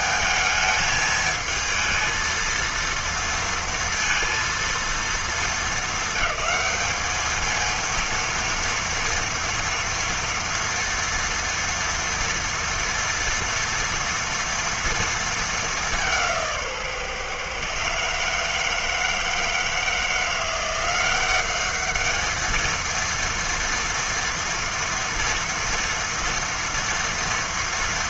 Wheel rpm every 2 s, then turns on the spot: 220, 230, 230, 220, 230, 230, 230, 230, 170, 150, 170, 220, 230, 240.
none